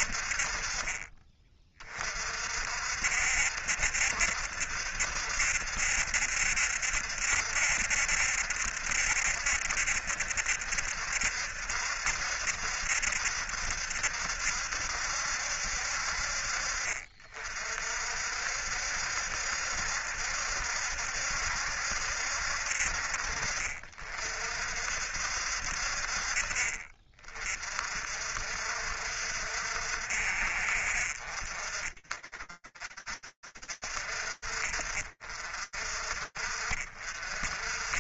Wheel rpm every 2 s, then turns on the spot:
30, 70, 70, 70, 70, 70, 70, 60, 50, 70, 70, 50, 60, 50, 60, 50, 40, 40, 40.
none